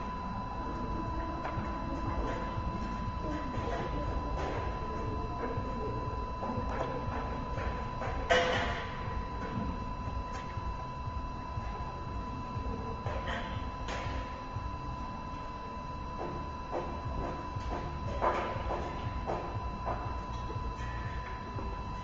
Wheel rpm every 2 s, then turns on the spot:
0, 0, 0, 0, 0, 0, 0, 0, 0, 0, 0.
none